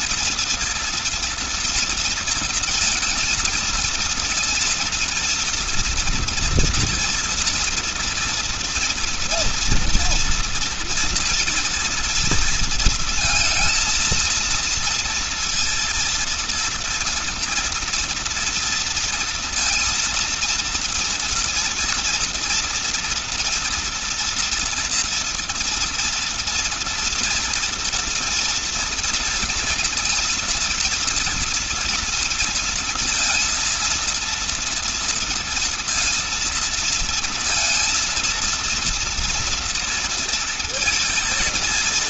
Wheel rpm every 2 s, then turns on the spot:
230, 230, 230, 230, 240, 230, 230, 230, 230, 230, 230, 240, 230, 230, 230, 230, 230, 230, 230, 230, 230.
none